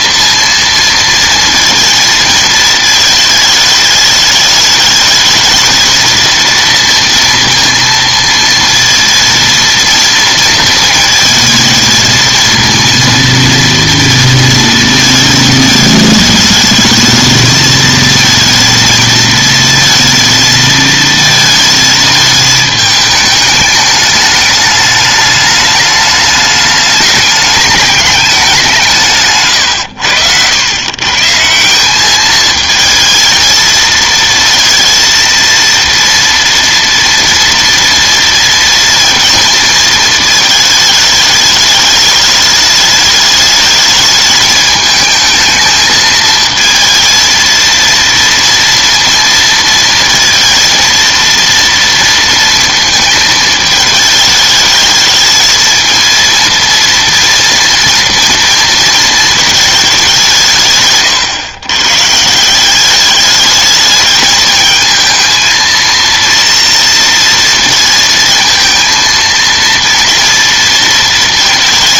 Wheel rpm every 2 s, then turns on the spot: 230, 220, 210, 230, 230, 230, 230, 230, 220, 230, 230, 220, 210, 210, 190, 100, 220, 230, 230, 230, 220, 210, 220, 220, 230, 230, 230, 220, 230, 230, 160, 180, 220, 230, 230, 230.
none